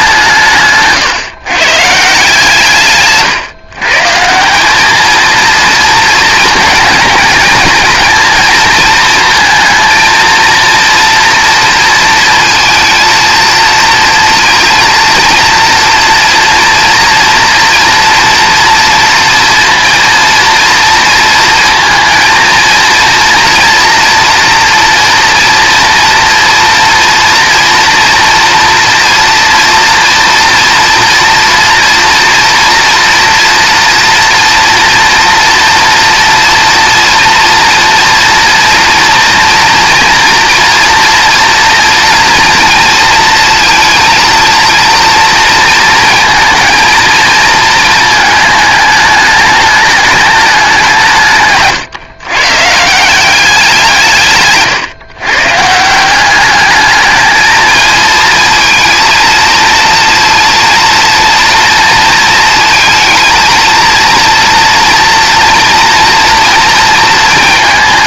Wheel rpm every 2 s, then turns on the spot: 150, 140, 200, 230, 230, 230, 230, 230, 230, 230, 230, 230, 230, 240, 230, 230, 230, 230, 230, 230, 230, 230, 230, 230, 210, 180, 160, 140, 200, 230, 230, 220, 230, 230.
none